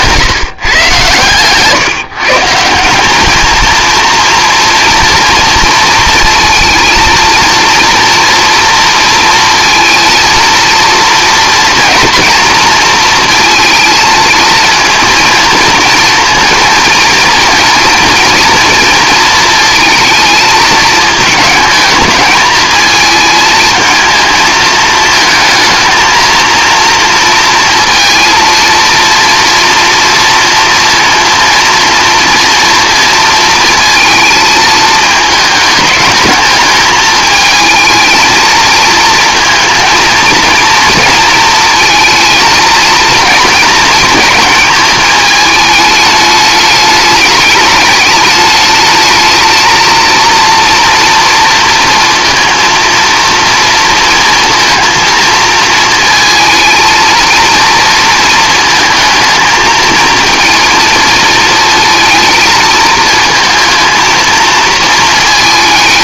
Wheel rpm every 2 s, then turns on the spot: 140, 180, 240, 230, 230, 230, 230, 230, 230, 230, 230, 220, 220, 230, 230, 230, 230, 220, 210, 220, 220, 220, 210, 210, 210, 240, 230, 230, 230, 220, 230, 220, 230.
none